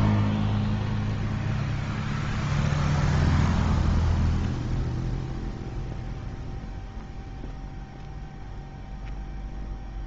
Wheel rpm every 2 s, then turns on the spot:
0, 0, 0, 0, 0.
none